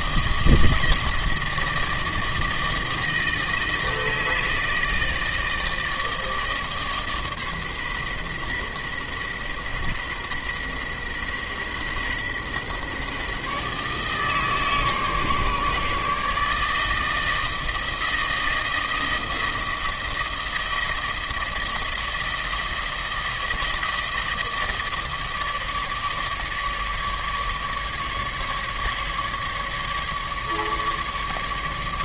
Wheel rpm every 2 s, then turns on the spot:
160, 160, 160, 150, 130, 130, 130, 150, 160, 160, 160, 160, 160, 150, 150, 150.
none